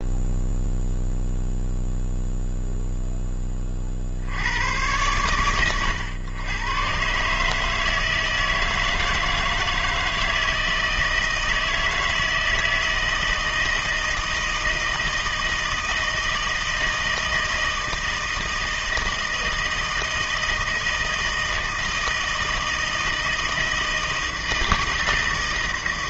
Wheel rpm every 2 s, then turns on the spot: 0, 0, 100, 120, 160, 160, 160, 160, 160, 160, 160, 160, 160.
none